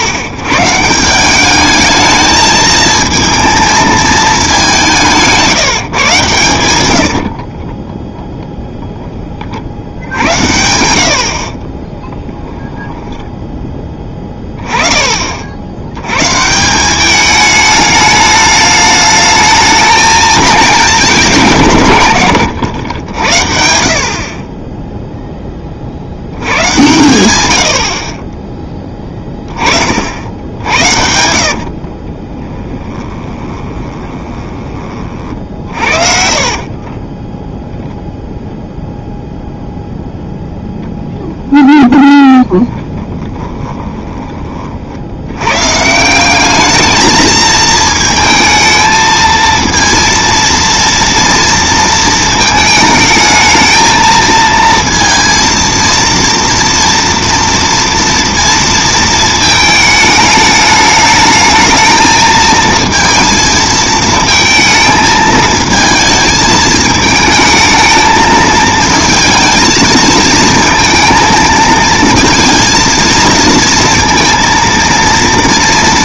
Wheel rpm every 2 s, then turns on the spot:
120, 220, 200, 110, 0, 90, 10, 10, 160, 210, 200, 90, 20, 110, 10, 80, 10, 30, 30, 0, 0, 20, 40, 210, 220, 230, 220, 230, 230, 230, 210, 220, 220, 220, 220, 230, 230, 230.
10-14 30-34 36-38 42-44